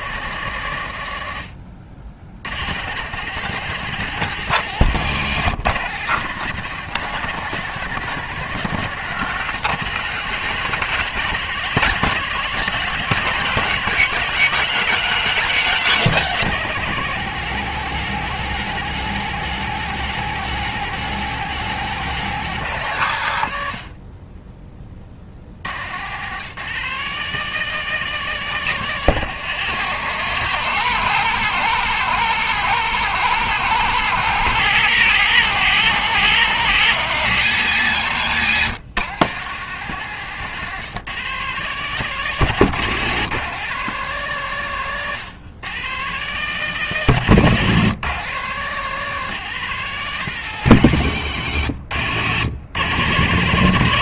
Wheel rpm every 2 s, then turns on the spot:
80, 140, 160, 160, 150, 160, 160, 170, 160, 160, 160, 140, 30, 170, 150, 120, 130, 130, 130, 130, 150, 160, 130, 150, 170, 130, 100.
none